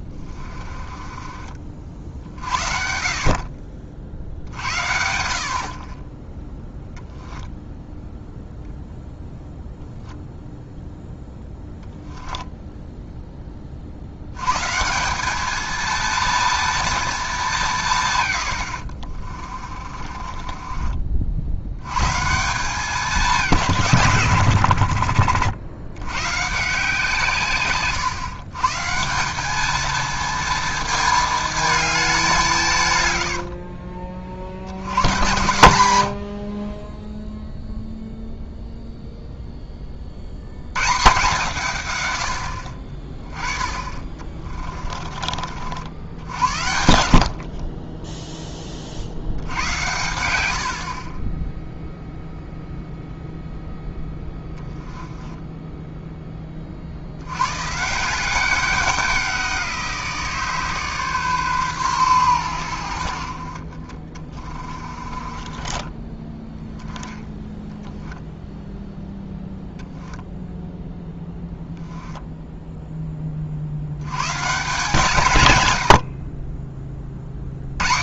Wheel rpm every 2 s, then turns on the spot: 30, 60, 60, 0, 0, 0, 0, 150, 230, 70, 40, 200, 80, 160, 150, 220, 160, 70, 40, 0, 120, 60, 30, 80, 30, 70, 0, 10, 40, 190, 150, 80, 30, 10, 0, 0, 10, 150, 30.
0-2 18-22 44-46 64-66